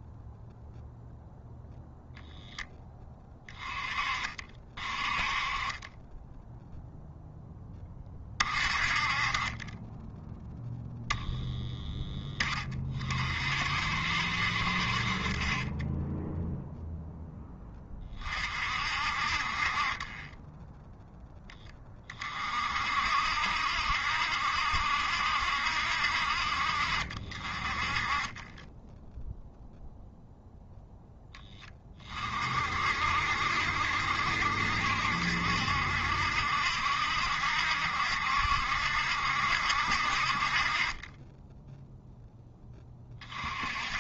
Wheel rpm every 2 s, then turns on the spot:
0, 10, 40, 0, 30, 10, 30, 50, 0, 50, 10, 50, 70, 50, 10, 0, 50, 70, 60, 60, 40, 20.
none